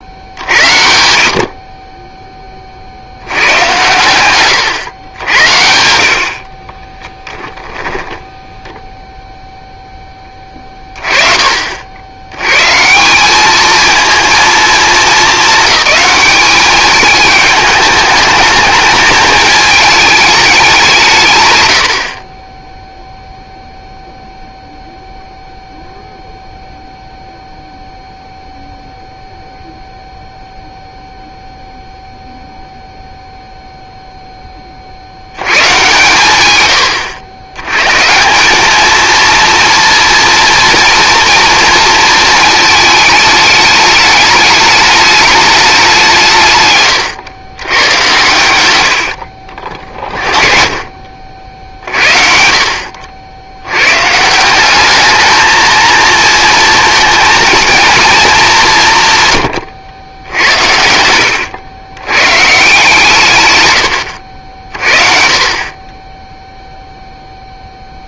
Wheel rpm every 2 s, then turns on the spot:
100, 40, 110, 40, 10, 30, 130, 220, 200, 210, 190, 10, 0, 0, 0, 0, 0, 30, 120, 210, 230, 220, 210, 140, 100, 40, 60, 180, 220, 180, 80, 150, 50, 0.
6-10